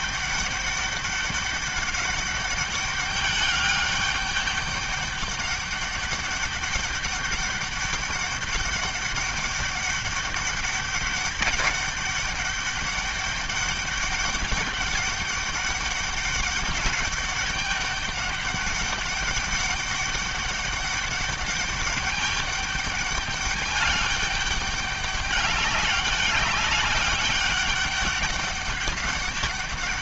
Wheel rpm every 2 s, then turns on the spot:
200, 200, 200, 200, 200, 200, 210, 200, 200, 200, 200, 200, 200, 200, 200.
none